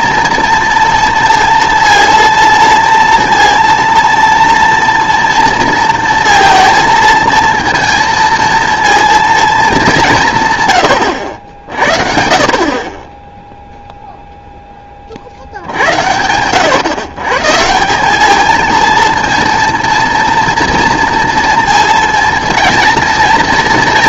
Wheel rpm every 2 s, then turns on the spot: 230, 230, 230, 230, 230, 120, 40, 10, 120, 230, 230, 230.
none